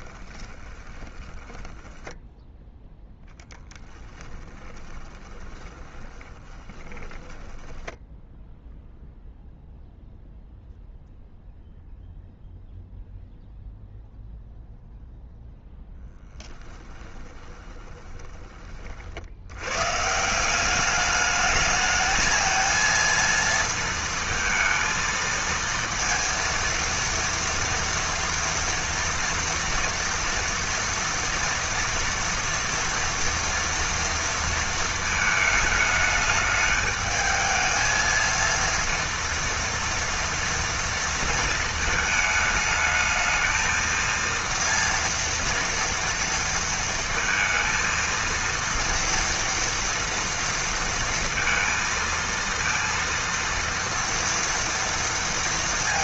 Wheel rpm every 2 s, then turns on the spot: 20, 10, 20, 20, 0, 0, 0, 0, 10, 40, 200, 230, 220, 230, 230, 240, 230, 220, 210, 230, 230, 220, 230, 230, 230, 230, 230, 230.
0-2 4-8 16-18